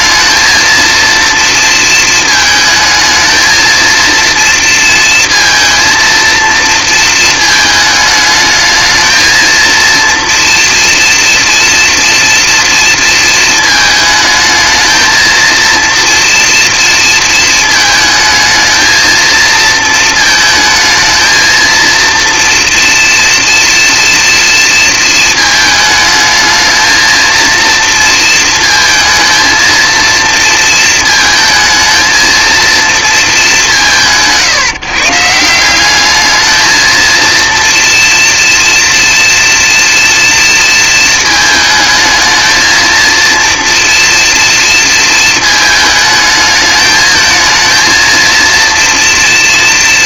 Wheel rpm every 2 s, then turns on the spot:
230, 220, 220, 220, 220, 230, 230, 220, 230, 220, 220, 230, 230, 220, 230, 230, 230, 150, 220, 230, 230, 230, 230, 220, 230.
none